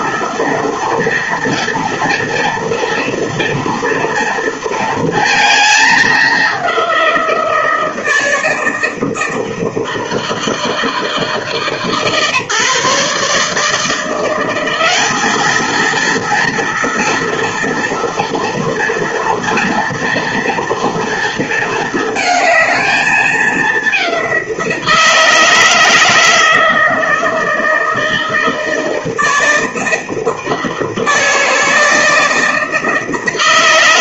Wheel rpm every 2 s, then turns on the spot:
230, 230, 230, 190, 160, 160, 150, 190, 230, 230, 230, 220, 170, 160, 160, 160, 160.
none